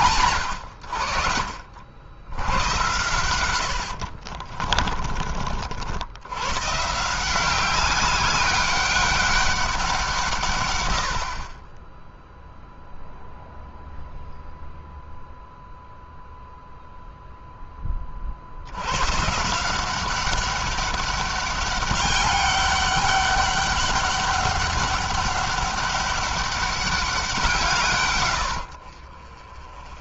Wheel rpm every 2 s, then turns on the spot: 80, 100, 40, 150, 200, 110, 0, 0, 0, 110, 200, 200, 200, 190, 70.
4-6